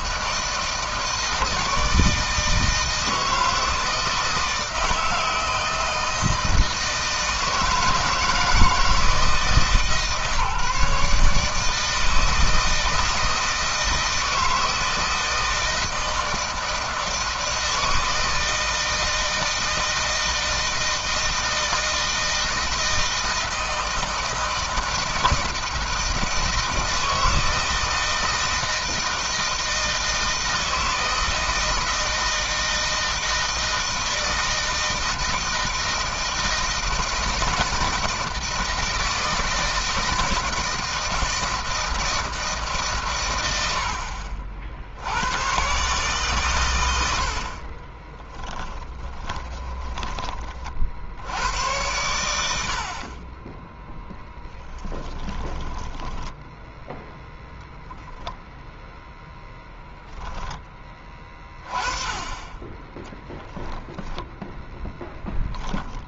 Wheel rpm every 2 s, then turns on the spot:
160, 160, 160, 160, 160, 150, 160, 160, 160, 160, 160, 160, 160, 160, 160, 160, 160, 160, 160, 160, 160, 150, 60, 120, 20, 40, 70, 10, 0, 0, 10, 10, 10.
48-50 54-56 64-66